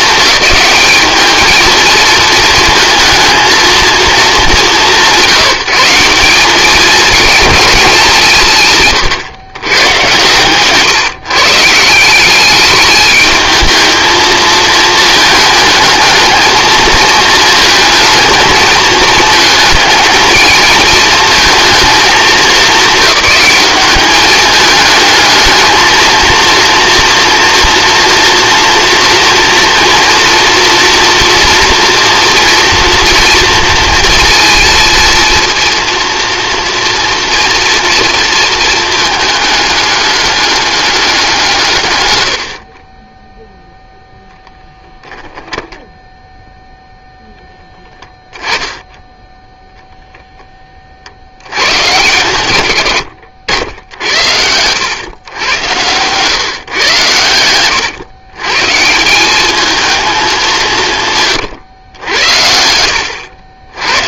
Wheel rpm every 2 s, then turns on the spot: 210, 220, 190, 210, 140, 140, 210, 220, 220, 220, 220, 200, 220, 230, 240, 230, 230, 230, 230, 220, 200, 40, 0, 0, 10, 50, 100, 110, 130, 160, 160, 90.
8-10 42-44 52-54 62-64